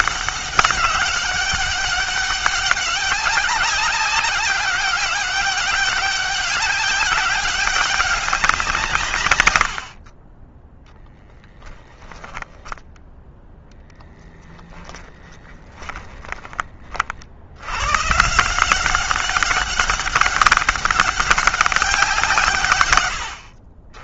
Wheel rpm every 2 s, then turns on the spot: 200, 200, 200, 200, 160, 10, 10, 10, 40, 180, 200, 130.
14-16